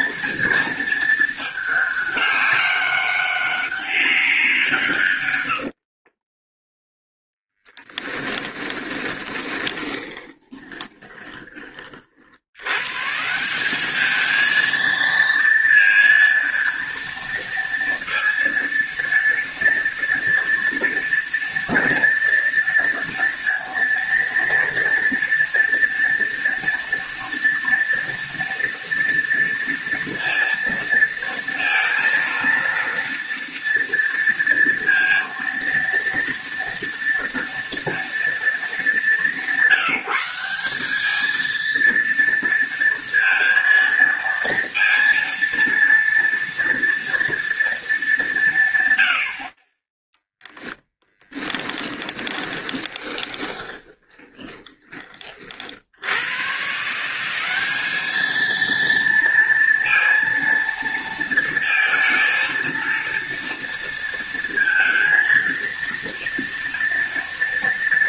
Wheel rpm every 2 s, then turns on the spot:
230, 200, 160, 10, 10, 30, 100, 230, 230, 230, 230, 230, 230, 230, 230, 230, 230, 230, 230, 200, 190, 230, 230, 230, 150, 10, 20, 20, 150, 230, 230, 230, 230, 230.
8-12 52-54